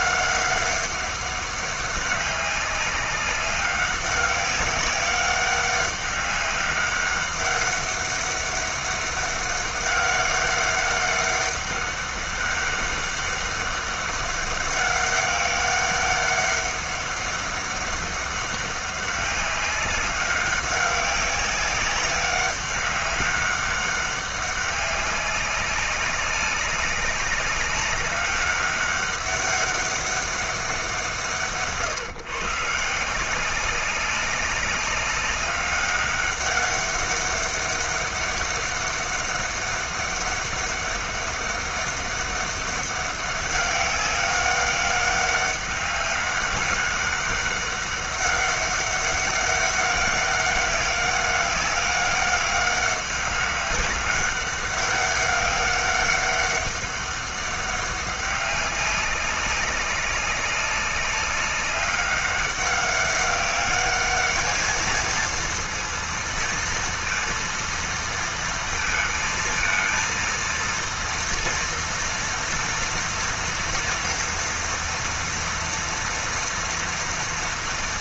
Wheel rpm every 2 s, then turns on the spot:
200, 200, 200, 200, 200, 200, 200, 200, 200, 200, 200, 200, 190, 190, 200, 190, 140, 190, 200, 200, 200, 200, 200, 200, 200, 200, 190, 200, 200, 200, 200, 200, 220, 230, 230, 230, 230, 230, 230.
none